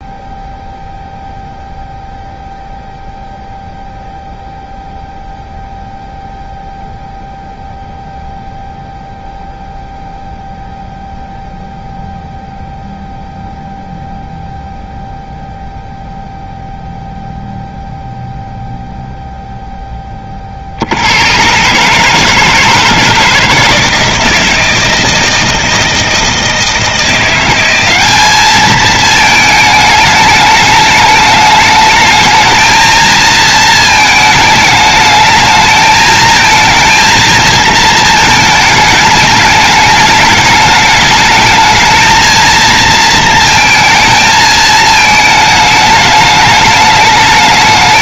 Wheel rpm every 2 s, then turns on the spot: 0, 0, 0, 0, 0, 0, 0, 0, 0, 0, 50, 160, 160, 160, 210, 210, 220, 210, 220, 220, 210, 230, 220, 210.
none